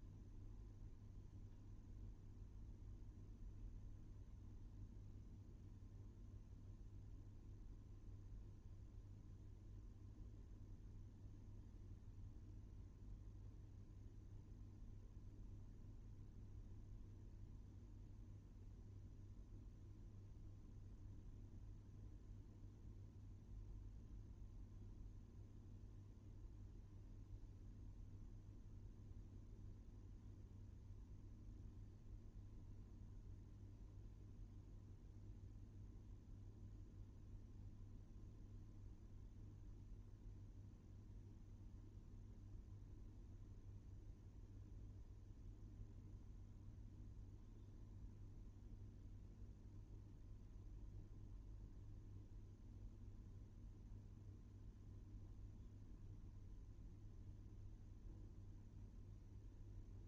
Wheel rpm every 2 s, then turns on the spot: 0, 0, 0, 0, 0, 0, 0, 0, 0, 0, 0, 0, 0, 0, 0, 0, 0, 0, 0, 0, 0, 0, 0, 0, 0, 0, 0, 0, 0, 0.
none